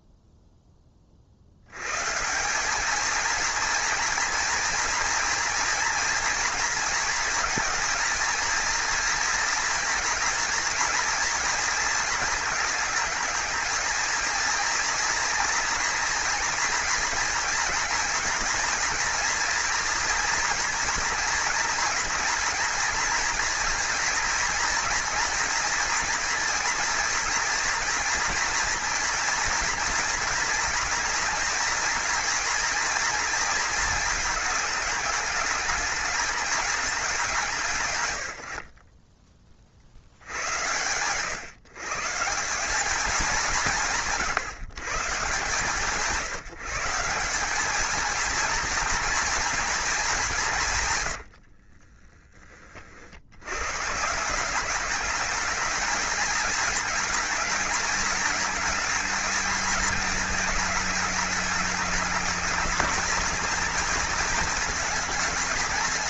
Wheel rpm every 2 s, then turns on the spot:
30, 210, 230, 230, 230, 230, 220, 230, 240, 230, 230, 240, 230, 230, 230, 230, 230, 220, 200, 50, 110, 200, 150, 170, 240, 140, 50, 200, 220, 220, 210, 230, 220.
50-52